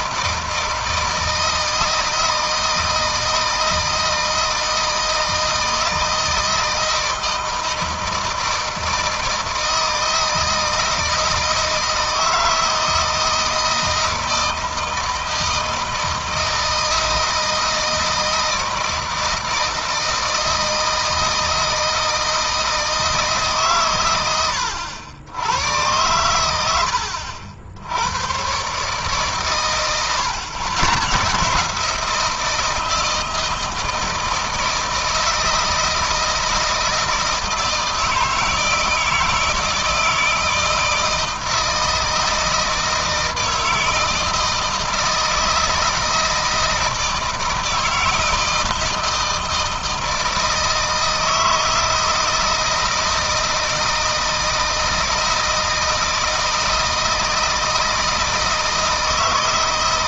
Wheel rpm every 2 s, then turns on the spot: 160, 160, 160, 160, 160, 160, 160, 160, 160, 160, 160, 160, 90, 80, 130, 140, 160, 160, 160, 160, 160, 160, 160, 160, 160, 160, 160, 160, 160, 160.
none